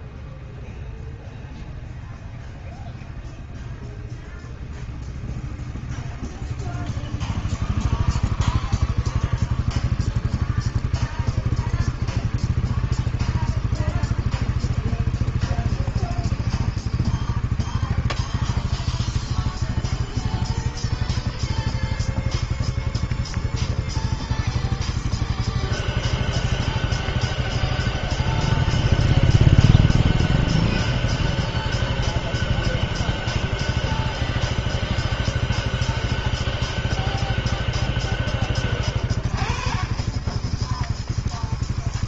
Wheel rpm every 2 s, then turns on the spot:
0, 0, 0, 0, 0, 0, 0, 0, 0, 0, 0, 0, 0, 0, 0, 0, 0, 0, 0, 20, 0.
none